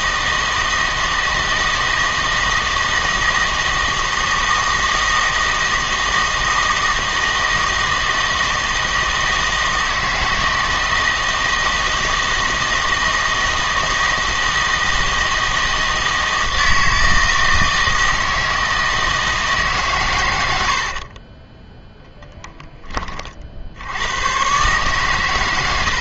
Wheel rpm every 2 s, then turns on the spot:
160, 160, 160, 160, 160, 160, 160, 160, 160, 160, 70, 20, 130.
20-22